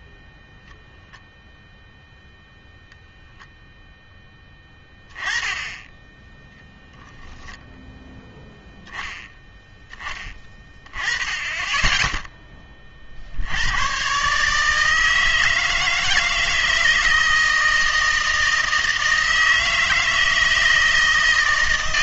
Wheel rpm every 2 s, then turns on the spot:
0, 0, 10, 0, 0, 20, 20, 150, 160, 160, 160.
none